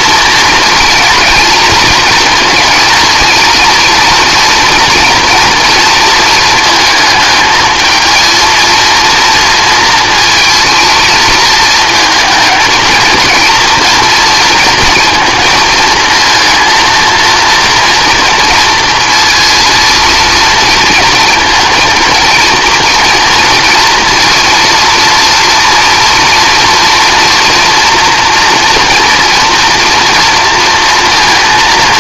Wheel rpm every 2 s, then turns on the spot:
230, 230, 230, 220, 230, 230, 230, 230, 230, 230, 230, 230, 230, 230, 230, 230.
none